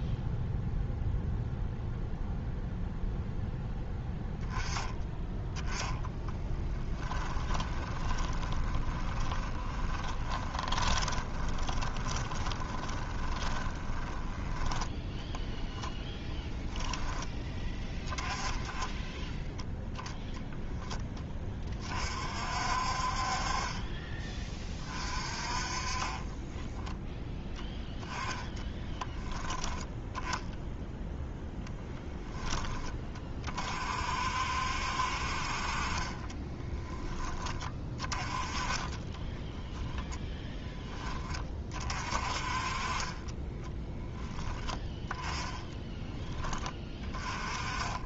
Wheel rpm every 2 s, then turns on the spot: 0, 0, 10, 10, 20, 20, 20, 10, 10, 10, 10, 50, 20, 10, 10, 0, 20, 60, 10, 20, 10, 30, 10, 10.
6-14 26-28 36-40